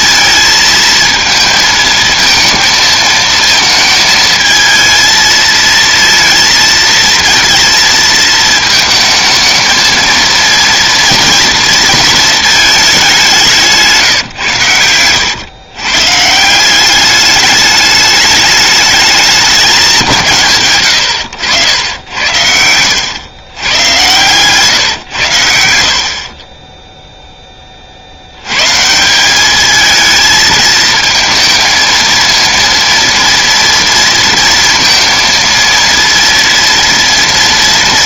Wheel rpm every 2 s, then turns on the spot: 220, 220, 220, 230, 220, 230, 220, 110, 190, 210, 110, 90, 130, 20, 140, 220, 230, 230, 230.
22-24